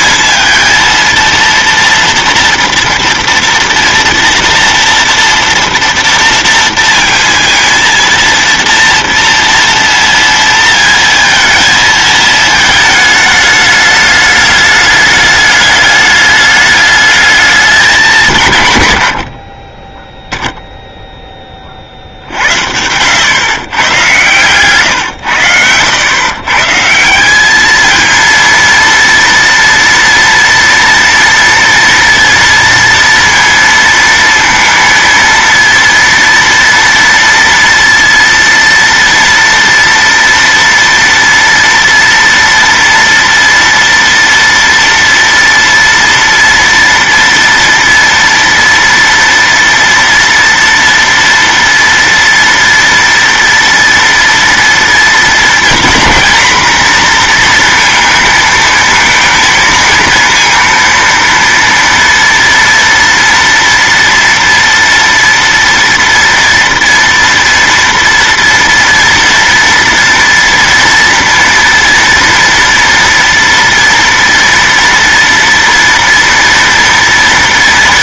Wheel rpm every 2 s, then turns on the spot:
230, 230, 230, 230, 230, 230, 220, 210, 210, 140, 0, 70, 120, 140, 230, 230, 230, 230, 230, 230, 230, 230, 230, 230, 230, 230, 230, 230, 240, 230, 230, 230, 240, 230, 230, 230, 230, 230, 230.
none